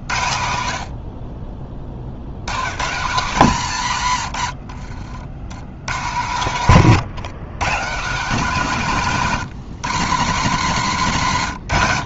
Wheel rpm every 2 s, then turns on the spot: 120, 80, 110, 160, 160, 120.
none